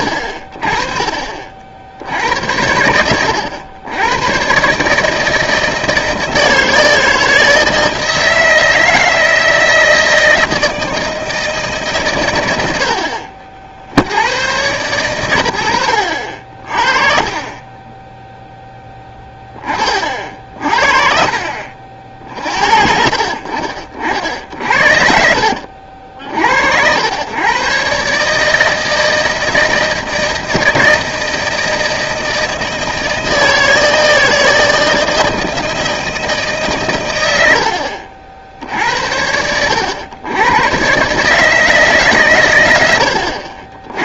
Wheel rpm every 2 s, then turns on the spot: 50, 80, 130, 160, 160, 160, 90, 110, 50, 10, 50, 60, 70, 70, 160, 160, 160, 160, 140, 60, 110, 110.
24-26